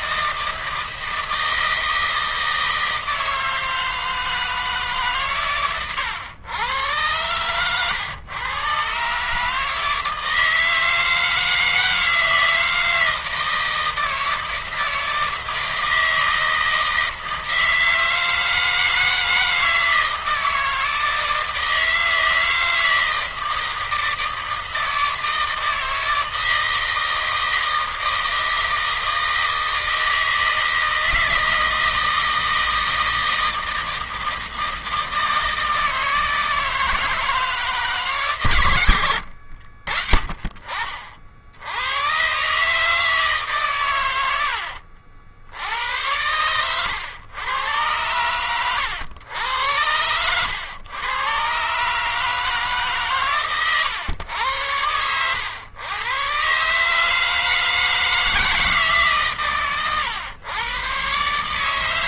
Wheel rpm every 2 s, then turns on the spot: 160, 160, 140, 120, 140, 160, 160, 160, 160, 160, 160, 160, 160, 160, 160, 160, 160, 160, 160, 90, 60, 140, 70, 100, 100, 120, 140, 100, 150, 140, 130.
none